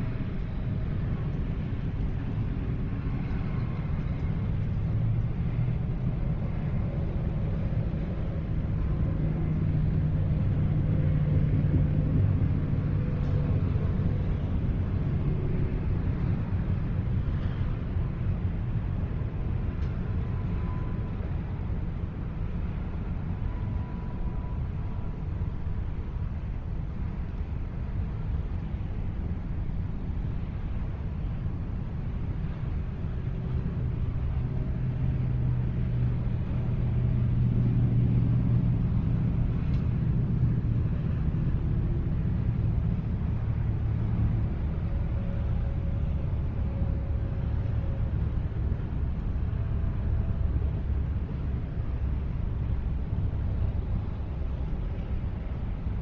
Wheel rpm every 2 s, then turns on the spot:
0, 0, 0, 0, 0, 0, 0, 0, 0, 0, 0, 0, 0, 0, 0, 0, 0, 0, 0, 0, 0, 0, 0, 0, 0, 0, 0, 0.
none